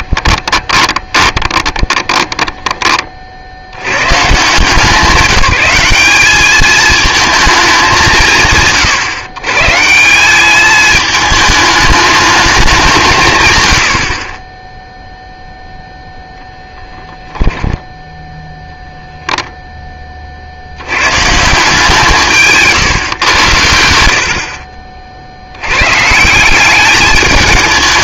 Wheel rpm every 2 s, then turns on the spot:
20, 20, 160, 220, 90, 210, 160, 10, 0, 0, 80, 140, 40, 200.
0-2 22-24